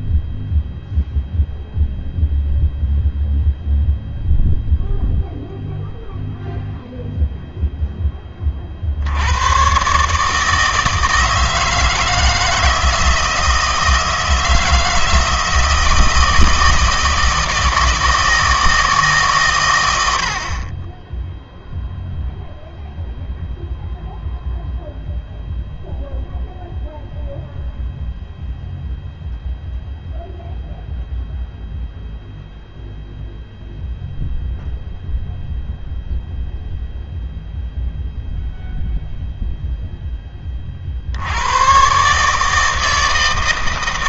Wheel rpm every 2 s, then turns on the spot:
0, 0, 0, 0, 40, 160, 160, 160, 160, 160, 30, 0, 0, 0, 0, 0, 0, 0, 0, 0, 30, 160.
none